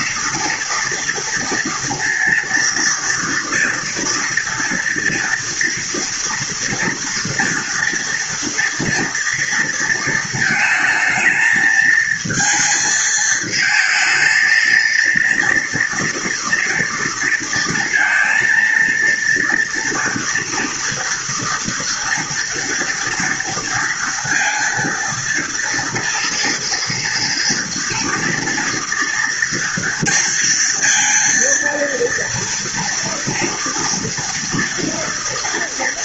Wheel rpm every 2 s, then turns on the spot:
230, 230, 240, 230, 230, 230, 220, 230, 230, 230, 230, 230, 230, 230, 230, 230, 230, 230.
none